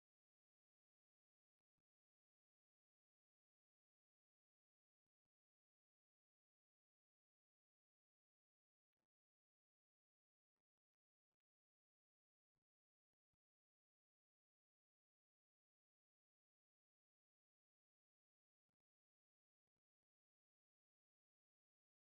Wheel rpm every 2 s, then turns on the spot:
0, 0, 0, 0, 0, 0, 0, 0, 0, 0, 0.
none